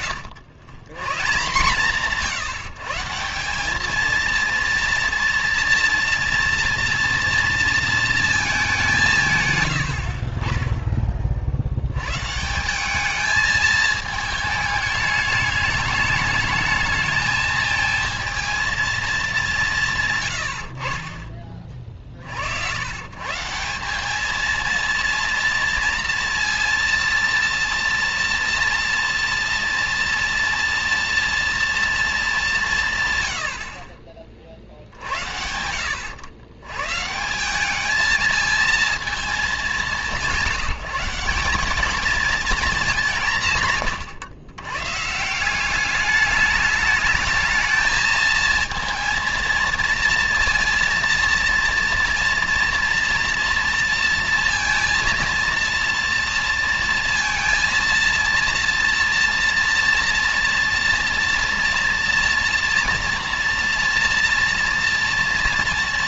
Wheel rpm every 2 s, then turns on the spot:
100, 170, 230, 230, 220, 50, 150, 220, 210, 230, 110, 60, 220, 230, 240, 230, 200, 30, 100, 220, 180, 230, 120, 200, 220, 230, 240, 230, 230, 230, 240, 230, 230.
none